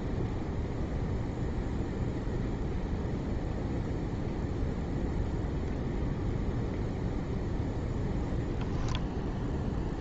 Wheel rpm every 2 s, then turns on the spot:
0, 0, 0, 0, 0.
none